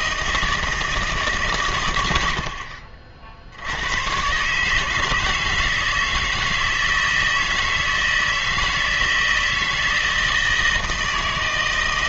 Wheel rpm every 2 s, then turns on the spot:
160, 60, 150, 160, 160, 160.
none